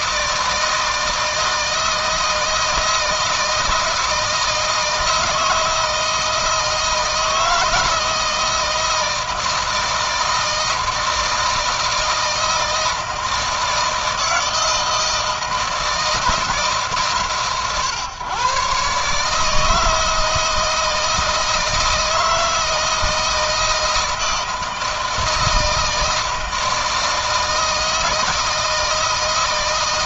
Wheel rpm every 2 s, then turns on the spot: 160, 160, 160, 160, 160, 160, 160, 160, 150, 140, 160, 160, 160, 160, 160.
none